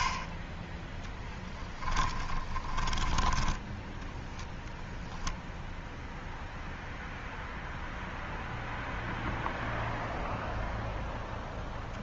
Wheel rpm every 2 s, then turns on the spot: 10, 20, 0, 0, 0, 0.
0-4